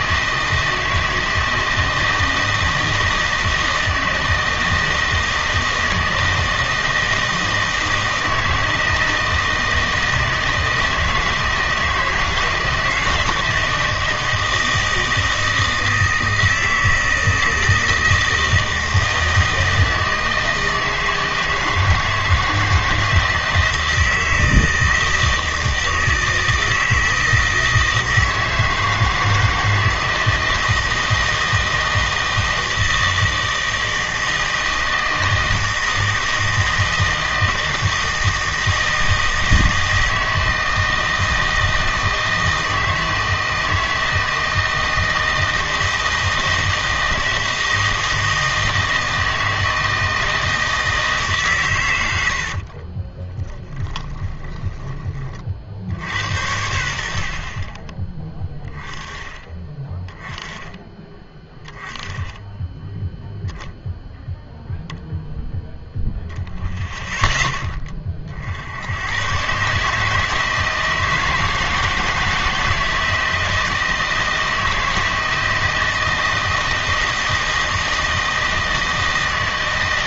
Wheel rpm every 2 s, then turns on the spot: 160, 160, 160, 160, 160, 160, 160, 160, 160, 160, 160, 160, 160, 160, 160, 160, 160, 160, 160, 160, 160, 160, 160, 160, 160, 160, 30, 20, 80, 20, 10, 0, 0, 0, 80, 160, 160, 160, 160, 160.
52-56